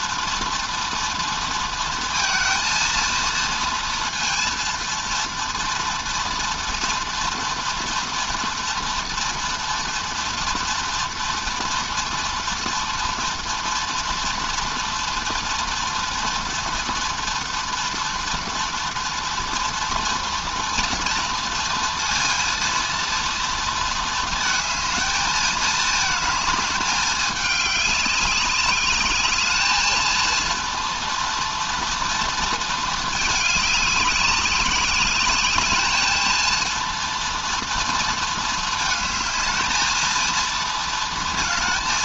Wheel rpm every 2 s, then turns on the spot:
230, 230, 230, 230, 230, 240, 230, 240, 240, 240, 230, 230, 220, 210, 200, 230, 220, 200, 230, 220, 230.
none